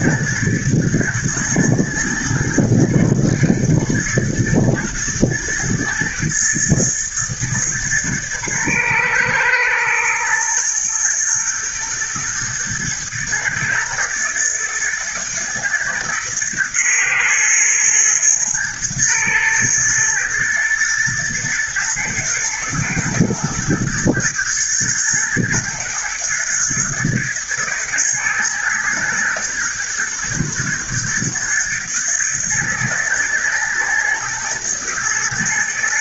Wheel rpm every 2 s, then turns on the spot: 120, 120, 120, 120, 110, 110, 110, 110, 120, 110, 110, 120, 110, 110, 110, 120, 110, 110.
none